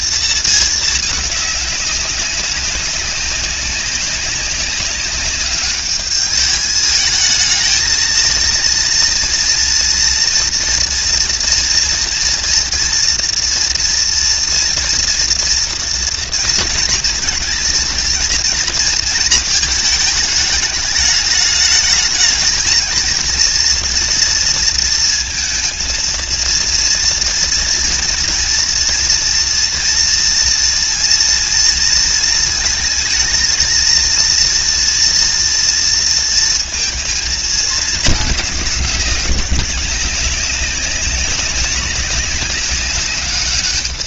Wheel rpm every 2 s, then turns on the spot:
210, 200, 200, 210, 230, 230, 230, 230, 230, 230, 210, 220, 230, 230, 230, 230, 220, 230, 230, 200, 200, 200.
none